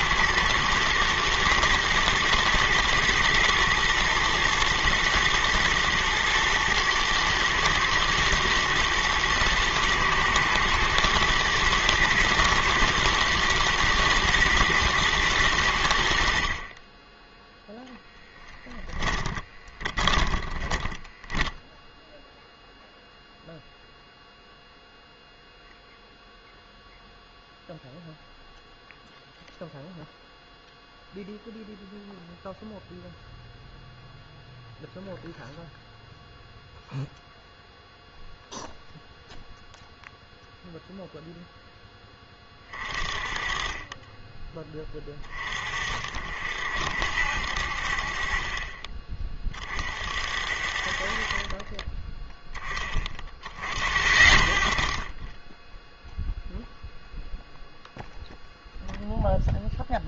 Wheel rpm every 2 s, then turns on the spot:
110, 110, 120, 110, 110, 110, 110, 110, 30, 10, 10, 0, 0, 0, 0, 0, 0, 0, 0, 0, 0, 20, 20, 60, 30, 50, 10, 40, 0, 0.
18-22